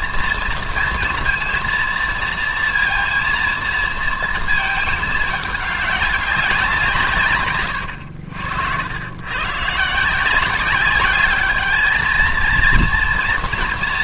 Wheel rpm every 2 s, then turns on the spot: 230, 230, 220, 150, 100, 200, 230.
none